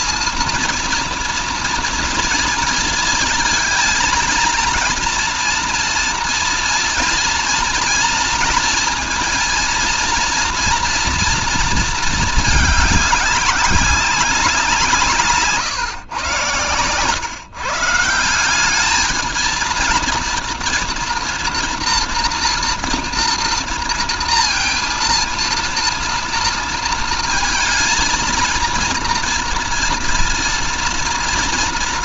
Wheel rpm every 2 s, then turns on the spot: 230, 230, 230, 230, 230, 230, 200, 150, 130, 220, 230, 240, 230, 230, 230, 230.
none